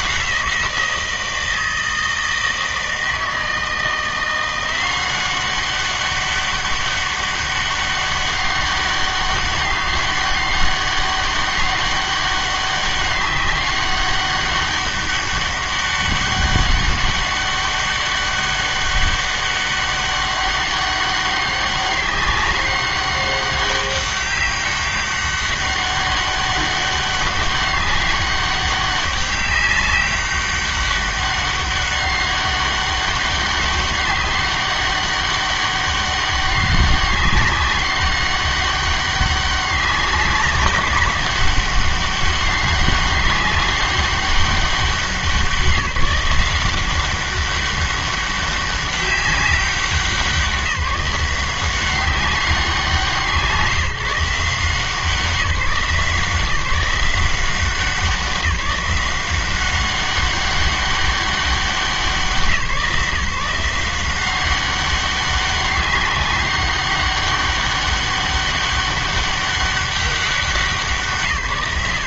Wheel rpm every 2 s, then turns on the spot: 170, 160, 180, 200, 200, 200, 200, 200, 200, 200, 200, 200, 200, 200, 200, 200, 200, 200, 200, 200, 190, 200, 190, 180, 200, 190, 190, 170, 160, 180, 200, 150, 190, 200, 200, 180.
none